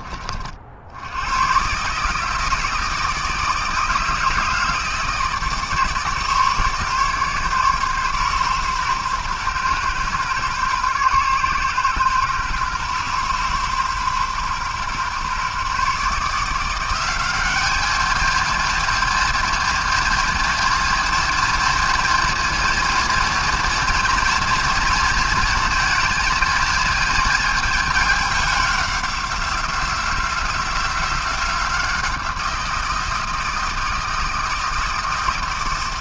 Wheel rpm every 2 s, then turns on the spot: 80, 160, 160, 150, 130, 130, 130, 130, 180, 230, 230, 230, 230, 220, 190, 180, 170, 160.
none